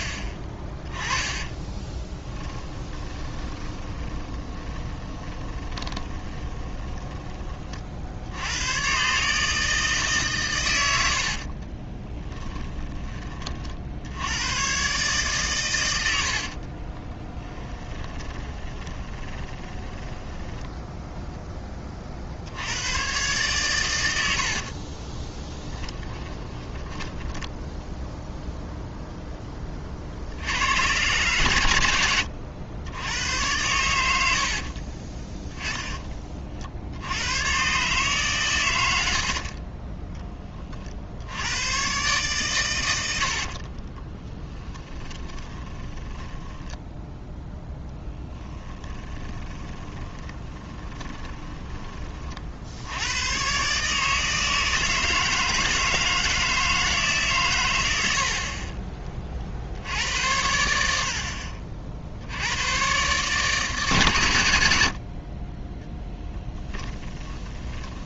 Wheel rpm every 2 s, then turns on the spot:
20, 20, 20, 20, 110, 100, 10, 130, 40, 20, 10, 110, 30, 10, 0, 90, 90, 40, 70, 100, 40, 100, 10, 10, 10, 20, 80, 160, 160, 30, 70, 110, 70, 10.
2-8 16-20 24-28 34-36 38-40 44-52 58-60 66-68